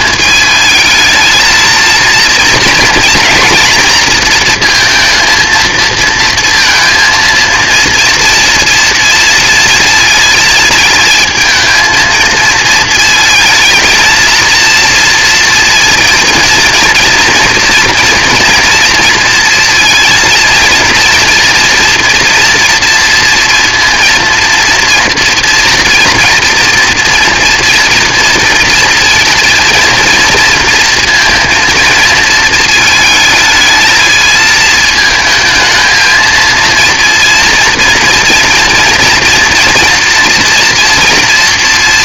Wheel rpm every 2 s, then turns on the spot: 220, 230, 230, 230, 230, 230, 230, 240, 230, 230, 230, 240, 230, 230, 230, 230, 220, 220, 230, 230, 240.
none